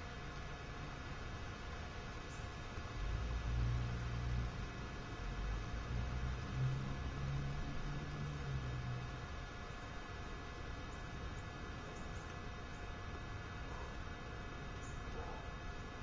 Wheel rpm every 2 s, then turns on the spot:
0, 0, 0, 0, 0, 0, 0, 0.
none